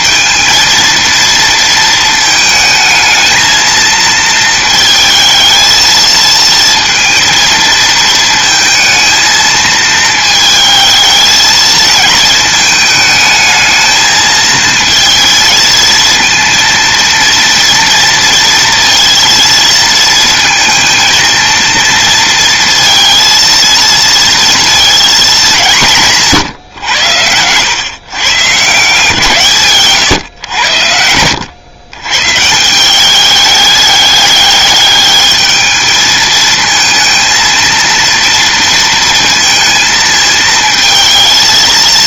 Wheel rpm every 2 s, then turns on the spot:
230, 220, 220, 230, 220, 220, 220, 220, 230, 230, 230, 230, 230, 110, 140, 90, 170, 210, 220, 230, 230.
30-32